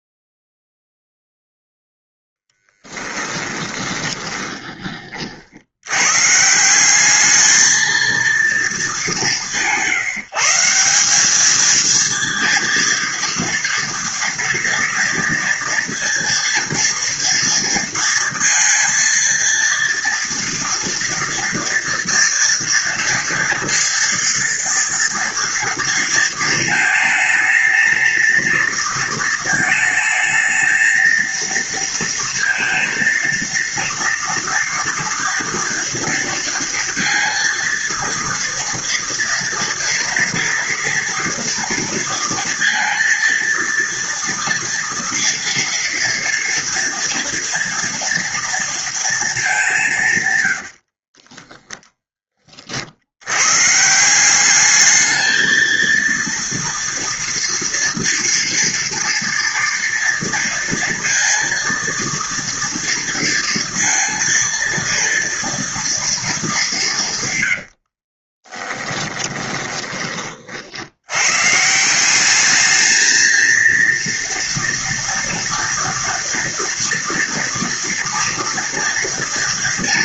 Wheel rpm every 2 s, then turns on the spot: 0, 10, 20, 170, 210, 180, 230, 230, 230, 230, 230, 230, 230, 230, 230, 220, 230, 230, 230, 230, 230, 230, 230, 230, 230, 70, 40, 200, 230, 230, 230, 230, 230, 190, 20, 70, 210, 230, 230, 240.
2-4 50-52 68-70